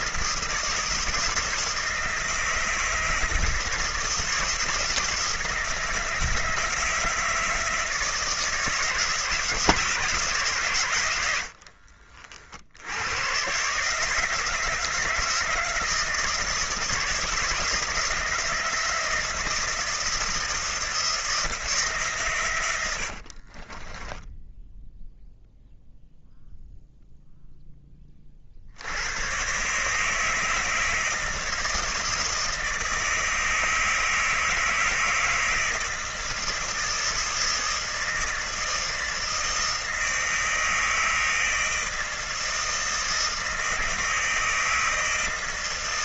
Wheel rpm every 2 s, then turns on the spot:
160, 160, 160, 160, 160, 120, 90, 160, 160, 160, 160, 100, 10, 0, 70, 160, 160, 160, 160, 160, 160, 160, 160.
22-24